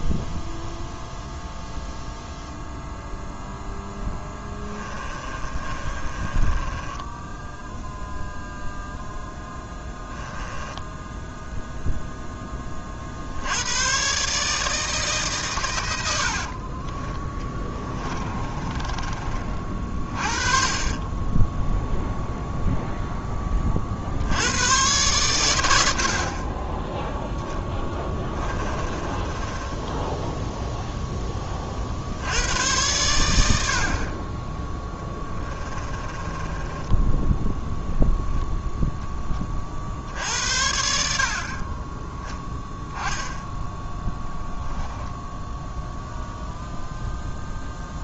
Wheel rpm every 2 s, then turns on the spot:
0, 0, 20, 10, 0, 10, 60, 150, 30, 30, 20, 0, 110, 10, 20, 0, 100, 10, 10, 10, 70, 10, 0, 0.
4-8 10-12 16-22 28-30 34-38